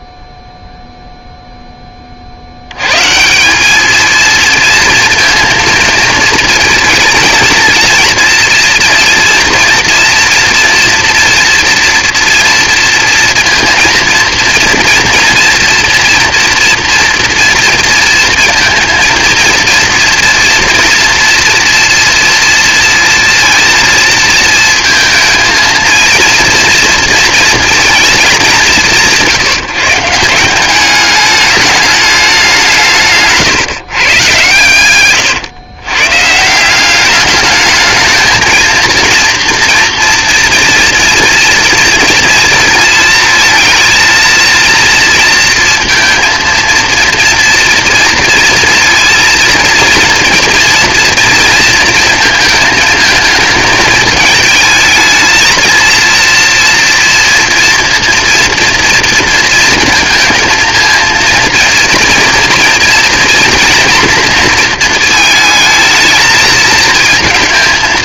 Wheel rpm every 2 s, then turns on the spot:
0, 90, 230, 220, 230, 240, 230, 230, 230, 230, 230, 230, 230, 230, 190, 190, 180, 120, 170, 230, 230, 220, 230, 230, 230, 230, 220, 220, 230, 230, 230, 230, 230, 230.
none